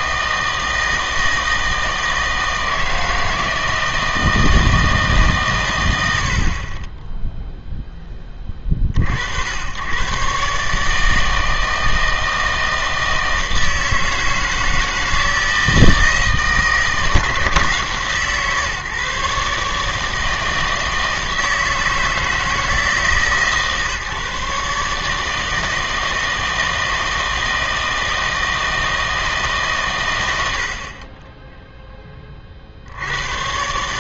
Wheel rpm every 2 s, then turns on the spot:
160, 160, 160, 40, 40, 150, 160, 160, 160, 150, 160, 160, 150, 160, 160, 60, 60.
none